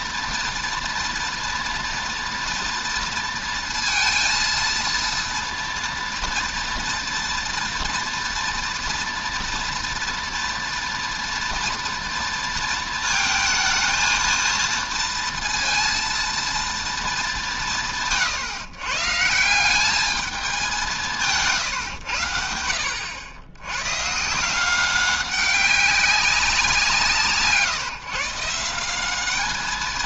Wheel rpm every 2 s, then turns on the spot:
230, 230, 230, 230, 240, 230, 220, 230, 220, 150, 180, 80, 190, 160, 180.
none